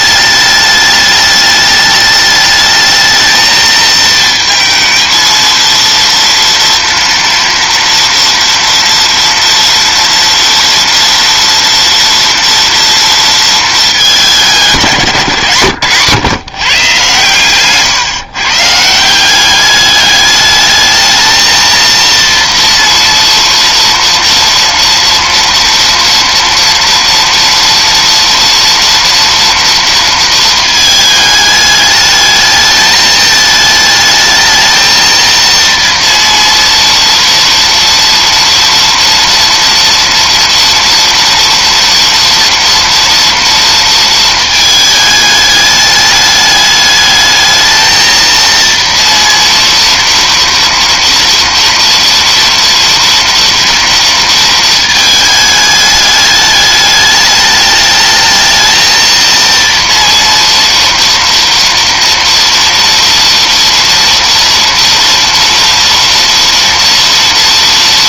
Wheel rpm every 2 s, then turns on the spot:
210, 220, 230, 230, 240, 230, 230, 170, 130, 150, 210, 230, 240, 230, 240, 220, 210, 220, 230, 230, 230, 230, 220, 210, 230, 230, 230, 230, 210, 220, 230, 230, 230, 230.
none